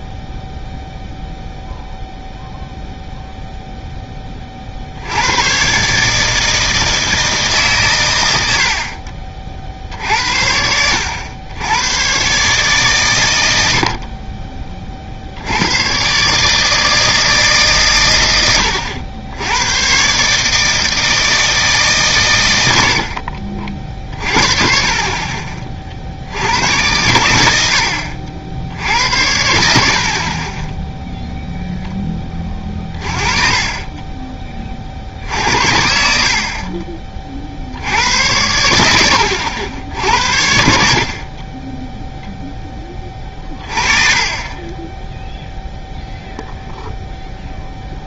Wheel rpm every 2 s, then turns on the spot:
0, 0, 60, 160, 70, 80, 130, 40, 160, 90, 150, 80, 40, 90, 70, 10, 30, 40, 40, 90, 60, 10, 20, 0.
none